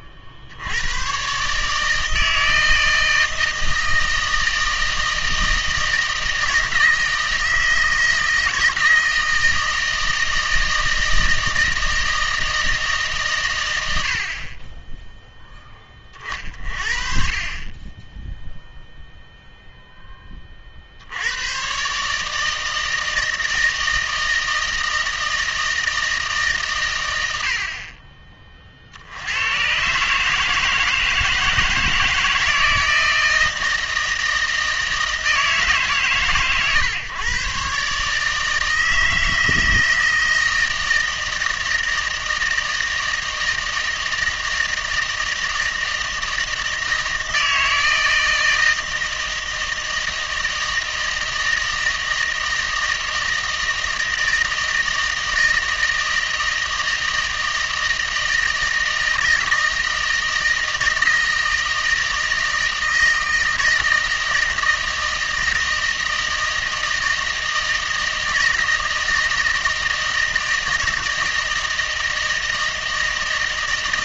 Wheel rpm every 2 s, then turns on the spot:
80, 160, 160, 160, 160, 160, 160, 20, 50, 0, 60, 160, 160, 120, 50, 160, 160, 160, 130, 160, 160, 160, 160, 160, 160, 160, 160, 160, 160, 160, 160, 160, 160, 160, 160, 160, 160.
none